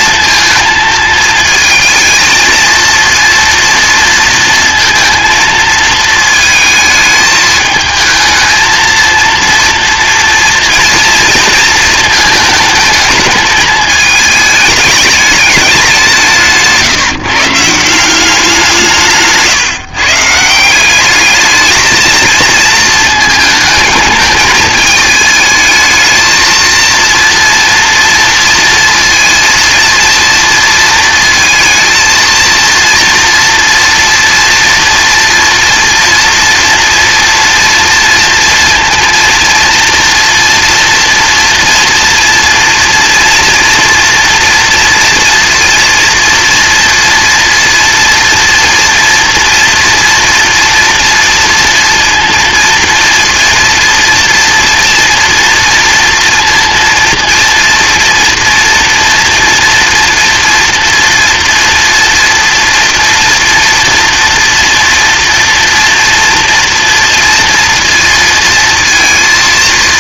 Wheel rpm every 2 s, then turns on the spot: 230, 230, 230, 220, 220, 230, 220, 210, 160, 180, 170, 220, 220, 230, 230, 230, 230, 230, 230, 230, 230, 230, 230, 230, 230, 230, 230, 230, 230, 230, 240, 230, 230, 230, 230.
16-18